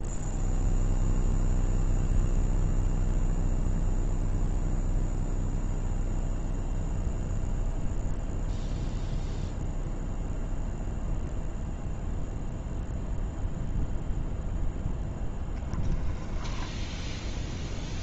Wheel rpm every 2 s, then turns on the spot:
0, 0, 0, 0, 0, 0, 0, 0, 10.
none